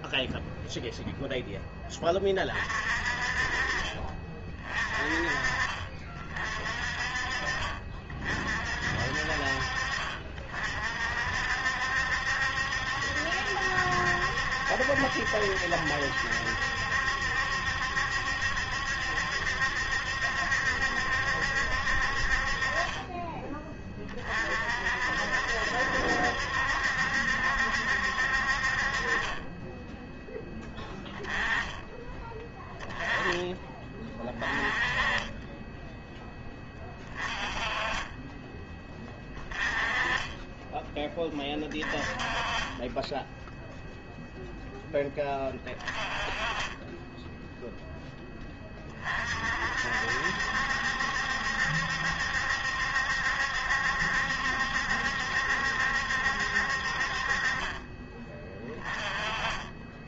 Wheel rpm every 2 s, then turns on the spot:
0, 30, 30, 40, 50, 50, 70, 70, 70, 70, 70, 40, 50, 70, 40, 20, 10, 20, 20, 20, 10, 10, 10, 20, 30, 70, 70, 70, 50, 20.
none